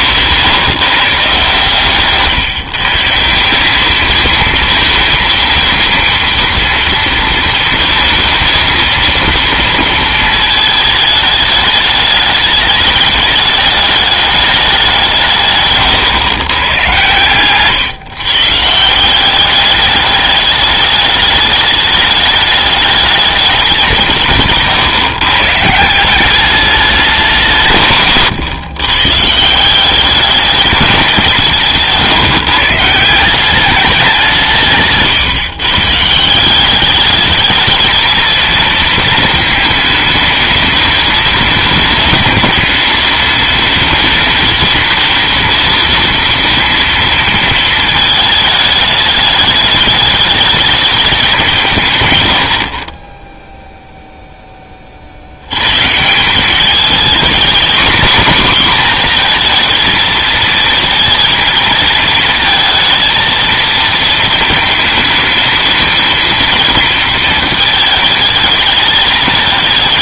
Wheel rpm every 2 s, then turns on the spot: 160, 150, 220, 230, 230, 220, 210, 200, 120, 140, 210, 210, 150, 200, 130, 210, 150, 150, 190, 230, 220, 210, 220, 230, 220, 210, 60, 20, 200, 240, 220, 220, 220, 220, 220.
none